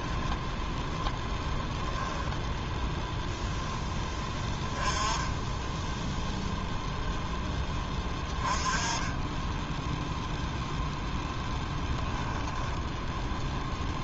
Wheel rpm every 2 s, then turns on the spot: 10, 0, 10, 0, 30, 0, 0.
0-2